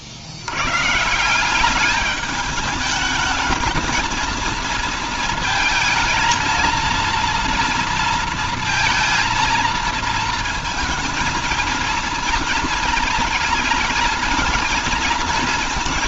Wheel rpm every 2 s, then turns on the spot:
120, 210, 220, 230, 230, 230, 220, 220.
none